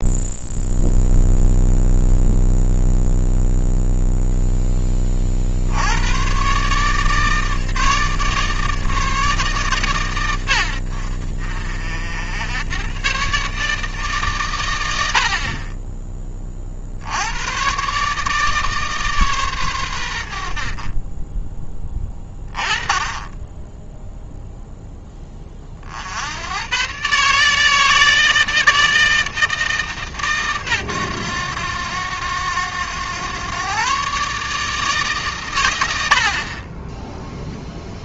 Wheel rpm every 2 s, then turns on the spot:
0, 0, 10, 140, 150, 90, 90, 100, 50, 150, 40, 20, 0, 110, 160, 120, 100, 150, 20.
none